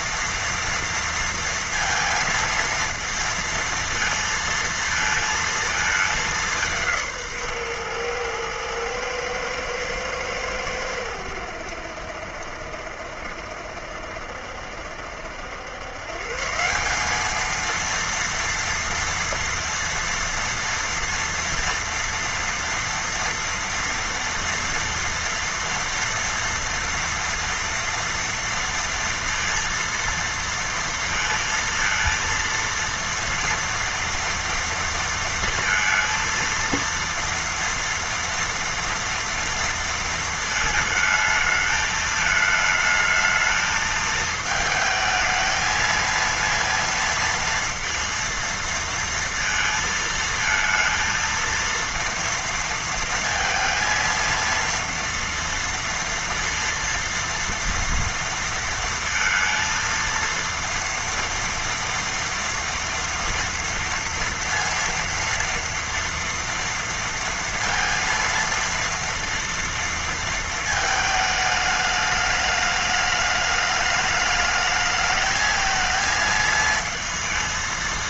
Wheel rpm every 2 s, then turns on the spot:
230, 230, 230, 200, 110, 110, 70, 70, 150, 230, 230, 230, 230, 230, 230, 230, 230, 230, 230, 230, 220, 220, 220, 230, 230, 220, 230, 230, 230, 230, 230, 230, 230, 230, 230, 220, 210, 210, 230.
none